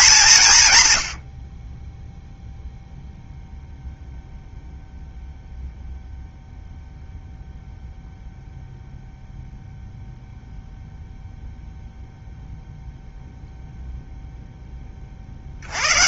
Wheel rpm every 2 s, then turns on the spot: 140, 0, 0, 0, 0, 0, 0, 10.
none